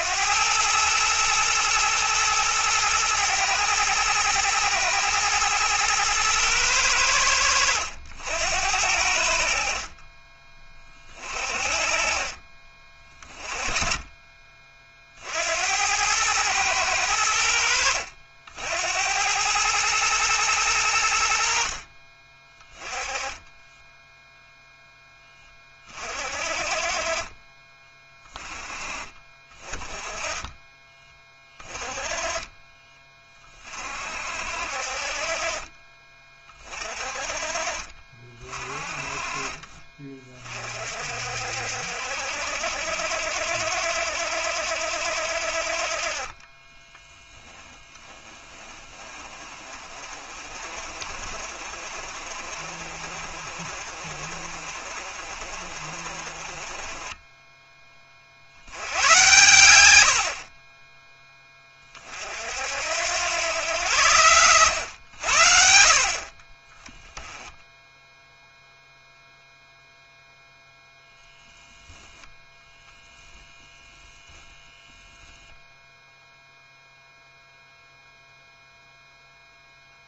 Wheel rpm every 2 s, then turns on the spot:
110, 110, 110, 100, 80, 40, 30, 40, 100, 90, 90, 20, 10, 30, 30, 20, 20, 50, 30, 30, 50, 60, 60, 10, 30, 40, 50, 50, 30, 90, 20, 80, 80, 10, 0, 0, 0, 0, 0, 0.
46-58